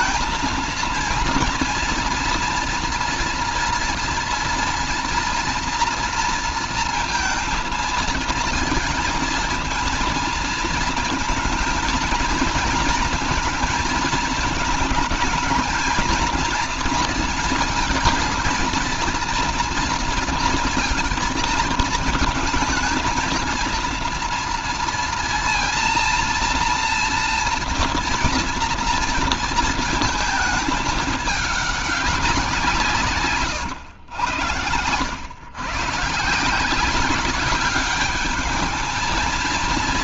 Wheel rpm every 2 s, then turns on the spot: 230, 230, 230, 230, 230, 230, 230, 220, 230, 230, 230, 220, 230, 230, 240, 210, 180, 90, 170, 220.
none